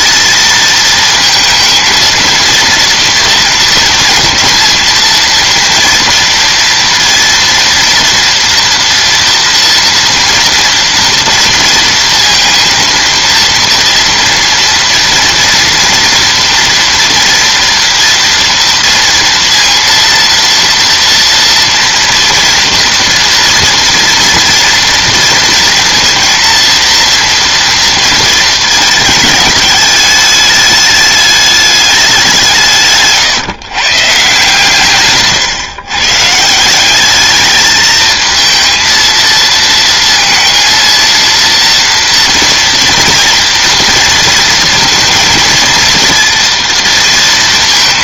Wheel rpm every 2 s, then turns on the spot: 230, 230, 230, 230, 230, 230, 230, 230, 230, 230, 230, 230, 230, 230, 220, 210, 150, 140, 190, 220, 230, 230, 230, 230.
none